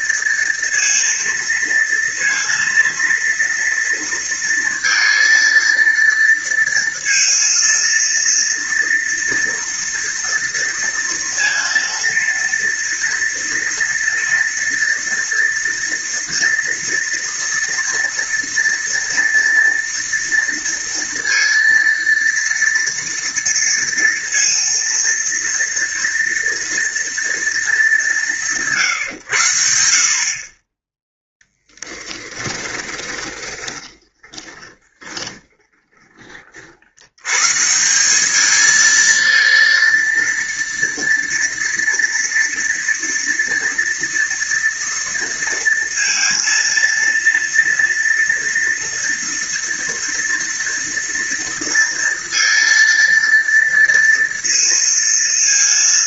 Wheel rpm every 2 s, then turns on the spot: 230, 230, 230, 230, 230, 230, 230, 230, 230, 230, 230, 230, 230, 230, 160, 20, 10, 20, 70, 220, 230, 230, 230, 230, 230, 230, 230, 230.
32-36